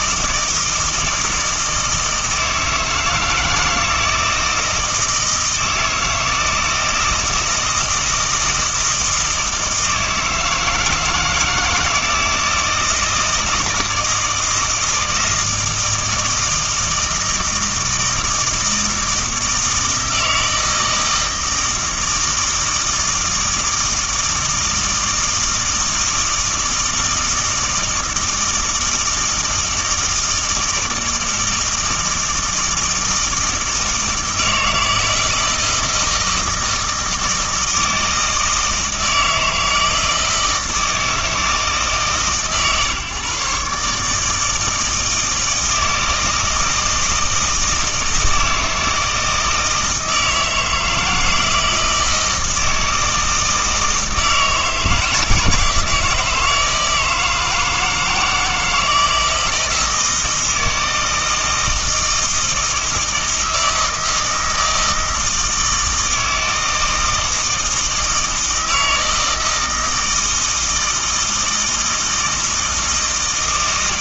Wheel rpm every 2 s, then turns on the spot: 160, 160, 160, 160, 160, 160, 160, 160, 160, 160, 160, 160, 160, 160, 160, 160, 170, 160, 160, 160, 160, 130, 160, 160, 160, 160, 160, 160, 160, 160, 160, 160, 160, 160, 160, 160, 160.
none